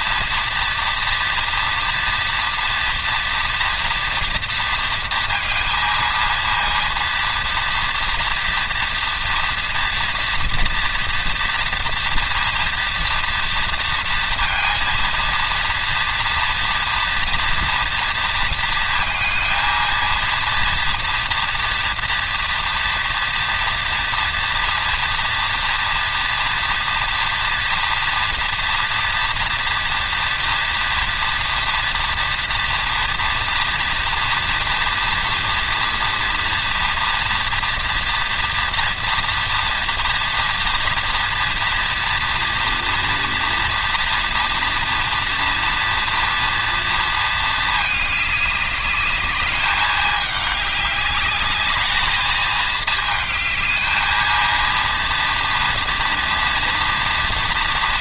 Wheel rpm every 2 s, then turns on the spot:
230, 230, 230, 230, 230, 230, 230, 230, 230, 230, 230, 230, 230, 230, 230, 240, 230, 230, 230, 230, 230, 230, 230, 230, 210, 210, 220, 230, 230.
none